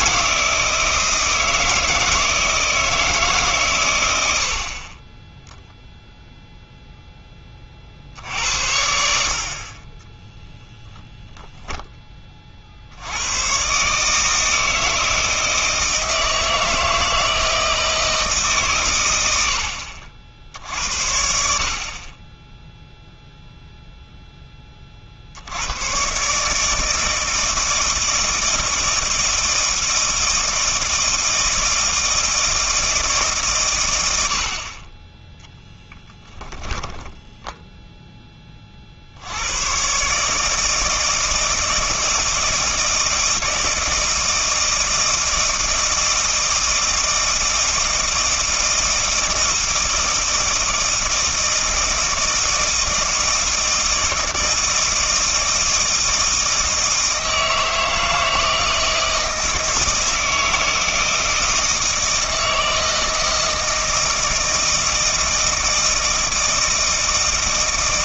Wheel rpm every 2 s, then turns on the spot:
160, 160, 40, 0, 80, 10, 60, 160, 160, 120, 70, 0, 30, 150, 160, 160, 160, 40, 10, 40, 160, 160, 160, 160, 160, 160, 160, 160, 160, 160, 160, 160, 160, 160.
36-38